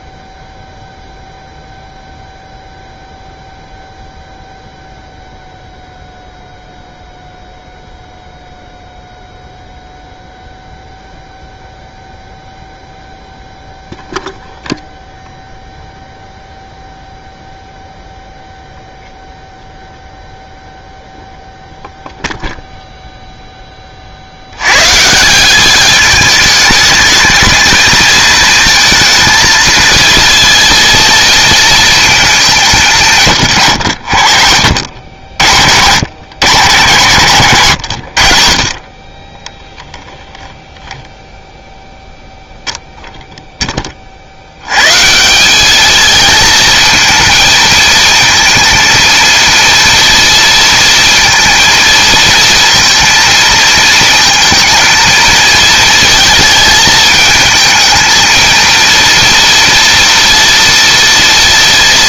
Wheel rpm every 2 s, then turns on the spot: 0, 0, 0, 0, 0, 0, 0, 0, 0, 0, 0, 0, 110, 210, 230, 230, 170, 50, 110, 30, 0, 0, 90, 220, 230, 230, 230, 230, 220, 230, 240.
none